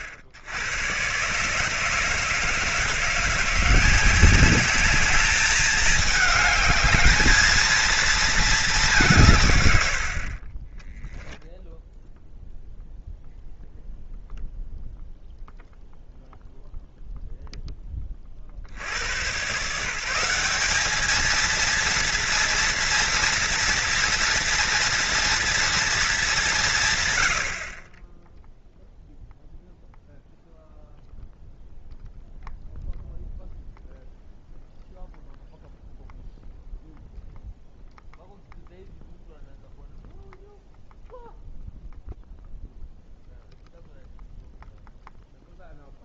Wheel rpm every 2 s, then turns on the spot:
90, 160, 200, 210, 220, 40, 0, 0, 0, 40, 170, 230, 230, 200, 10, 0, 0, 0, 0, 0, 0, 0, 0.
none